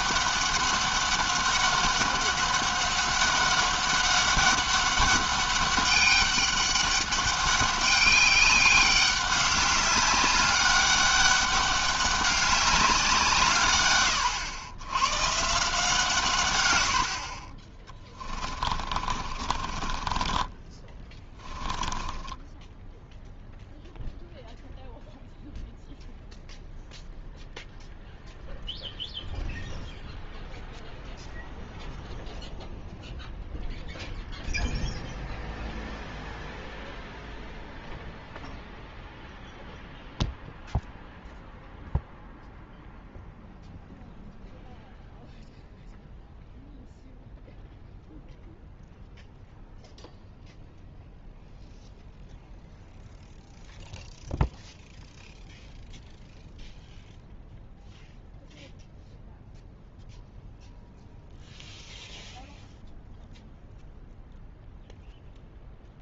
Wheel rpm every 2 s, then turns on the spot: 200, 200, 200, 200, 200, 200, 190, 110, 100, 30, 10, 10, 0, 0, 0, 0, 0, 0, 0, 0, 0, 0, 0, 0, 0, 0, 0, 0, 0, 0, 0, 0, 0.
18-22